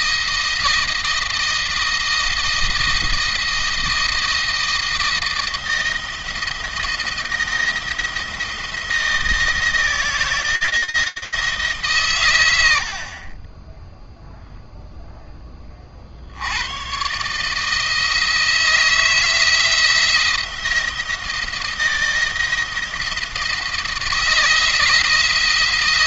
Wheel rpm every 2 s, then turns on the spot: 160, 160, 170, 170, 170, 160, 80, 0, 110, 160, 170, 170, 160.
none